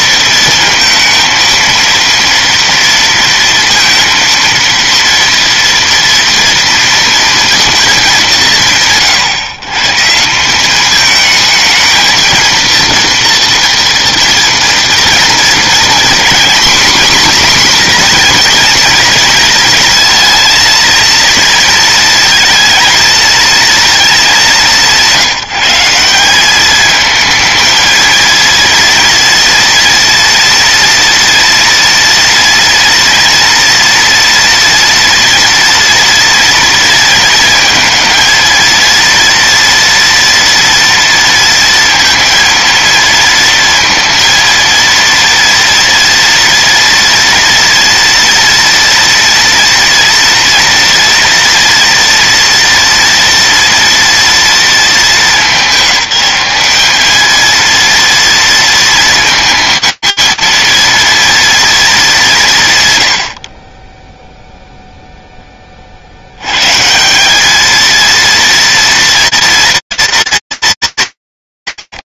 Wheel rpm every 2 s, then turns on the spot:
230, 230, 230, 230, 160, 210, 230, 230, 250, 230, 230, 220, 180, 210, 230, 230, 230, 230, 230, 230, 230, 230, 230, 230, 230, 230, 230, 210, 200, 230, 230, 120, 0, 150, 230, 210.
none